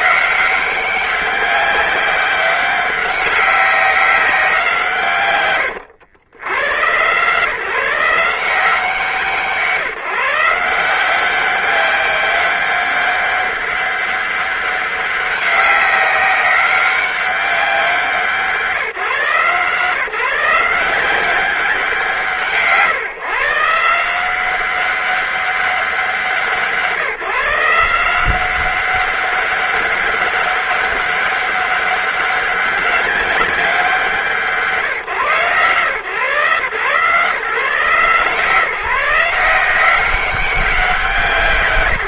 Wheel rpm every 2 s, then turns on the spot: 190, 190, 160, 110, 160, 170, 190, 190, 190, 160, 170, 150, 190, 150, 190, 200, 200, 170, 140, 160, 190.
none